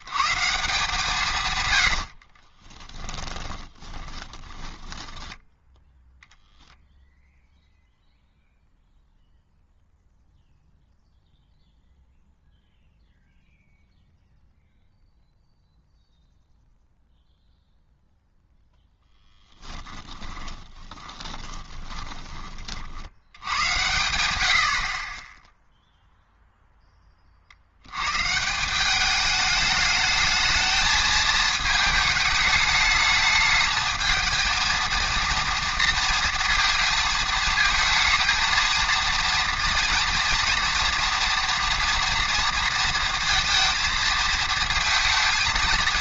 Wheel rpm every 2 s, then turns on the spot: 150, 20, 20, 0, 0, 0, 0, 0, 0, 0, 10, 50, 70, 0, 170, 220, 210, 230, 230, 220, 230, 230, 230.
2-6 20-22